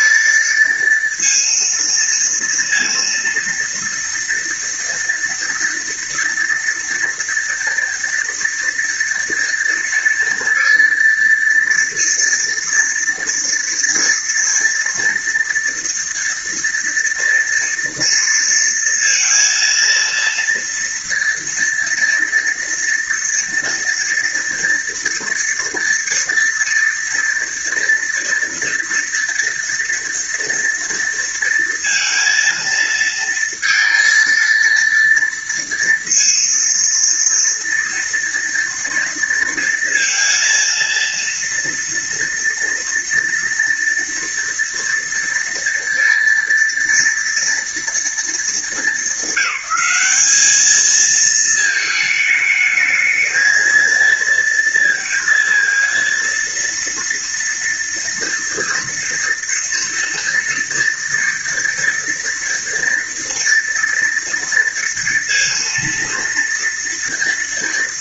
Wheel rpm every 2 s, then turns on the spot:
230, 230, 230, 230, 230, 230, 230, 230, 230, 230, 230, 230, 230, 230, 230, 230, 230, 230, 230, 240, 230, 230, 230, 230, 230, 210, 220, 230, 230, 230, 230, 230, 230, 230.
none